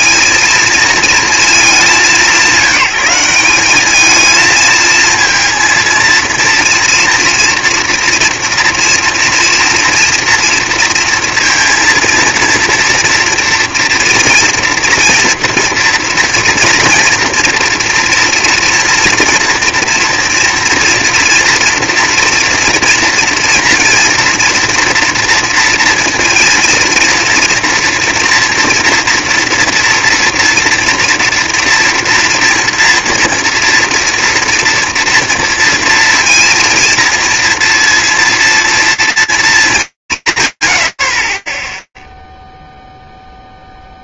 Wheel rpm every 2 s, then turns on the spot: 230, 190, 230, 230, 230, 230, 230, 230, 240, 230, 230, 230, 230, 230, 230, 240, 230, 230, 230, 230, 40, 0.
none